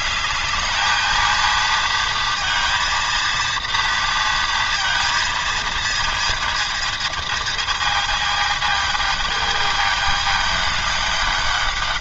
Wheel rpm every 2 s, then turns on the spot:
210, 230, 230, 230, 220, 210.
none